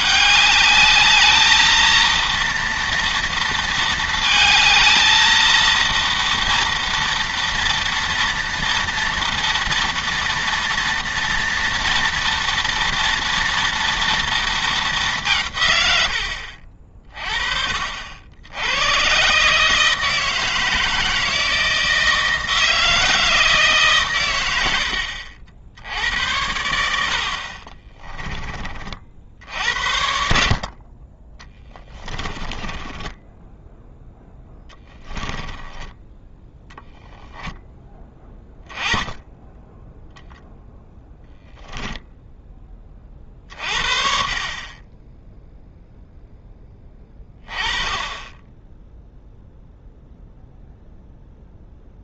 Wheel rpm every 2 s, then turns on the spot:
210, 230, 230, 230, 230, 230, 230, 210, 40, 100, 160, 160, 70, 80, 40, 40, 20, 10, 10, 10, 0, 20, 20, 10, 0, 0.
32-38